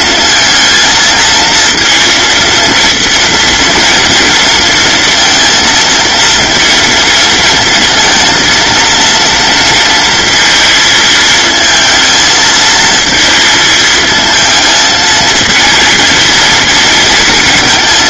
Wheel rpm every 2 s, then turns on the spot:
230, 230, 230, 230, 230, 230, 220, 220, 230.
none